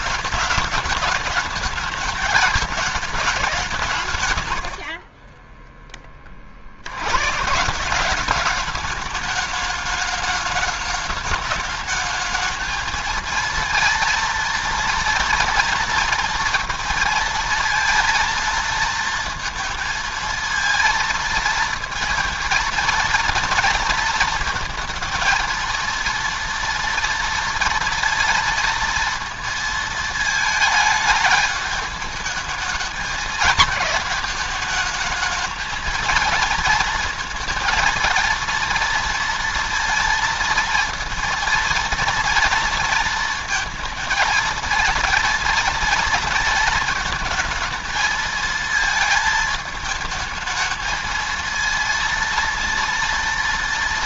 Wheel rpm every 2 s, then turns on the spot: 210, 210, 90, 60, 200, 210, 220, 230, 230, 230, 230, 230, 230, 230, 230, 220, 220, 220, 230, 230, 230, 230, 220, 220, 220, 220, 230.
4-6